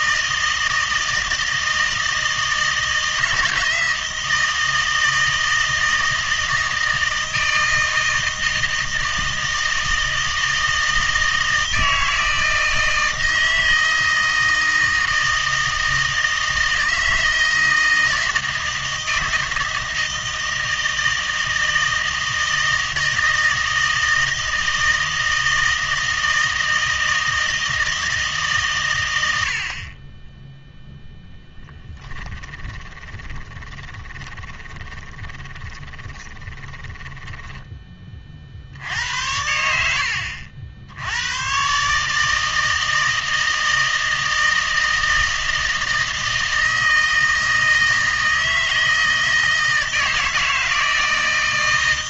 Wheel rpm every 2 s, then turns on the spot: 160, 160, 160, 160, 160, 160, 160, 160, 160, 160, 160, 160, 160, 160, 130, 0, 10, 20, 20, 70, 70, 160, 160, 160, 160, 160.
32-38